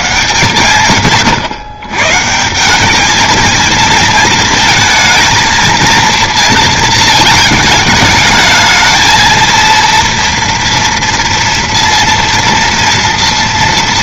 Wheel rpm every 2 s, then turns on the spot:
90, 140, 230, 230, 220, 230, 230.
none